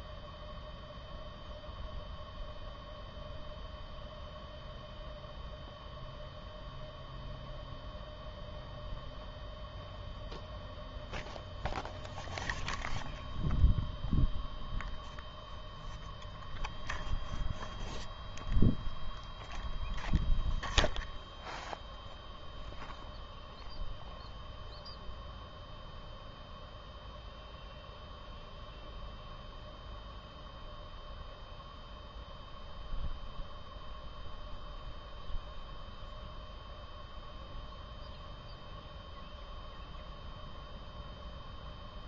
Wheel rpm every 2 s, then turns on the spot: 0, 0, 0, 0, 0, 0, 0, 0, 0, 0, 0, 0, 0, 0, 0, 0, 0, 0, 0, 0, 0.
none